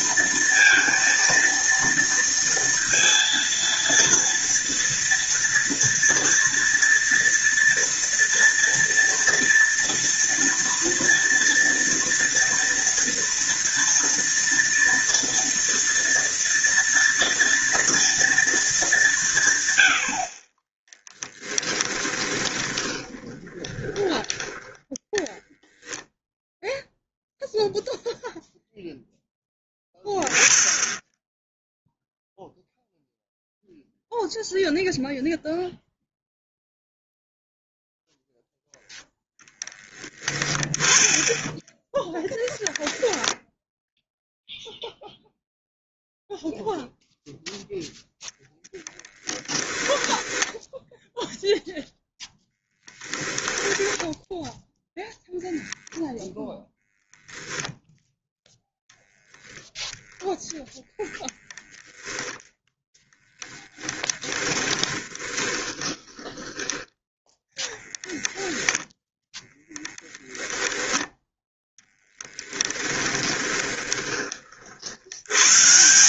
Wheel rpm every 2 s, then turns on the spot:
230, 230, 230, 230, 230, 230, 230, 230, 230, 190, 20, 20, 10, 0, 0, 10, 0, 0, 0, 0, 10, 0, 0, 0, 10, 0, 10, 0, 0, 0, 0, 10, 20, 10, 10, 0, 10, 80.
20-24 48-50 52-54 64-66 72-74